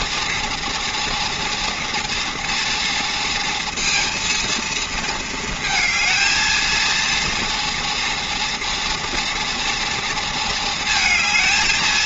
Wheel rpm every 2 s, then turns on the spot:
230, 240, 230, 230, 230, 220.
none